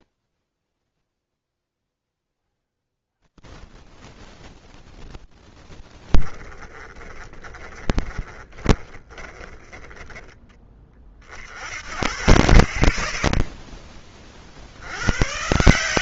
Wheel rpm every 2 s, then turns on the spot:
0, 20, 20, 20, 20, 10, 40, 50.
4-10